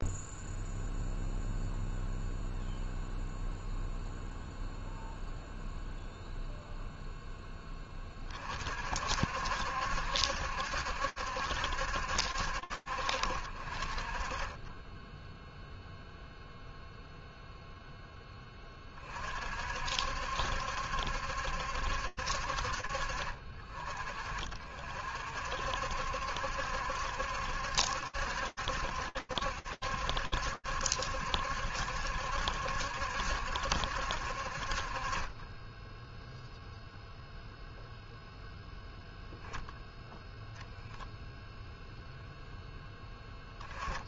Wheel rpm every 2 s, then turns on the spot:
0, 0, 0, 0, 30, 70, 60, 30, 0, 10, 60, 60, 40, 70, 70, 70, 70, 50, 0, 0, 0, 10.
none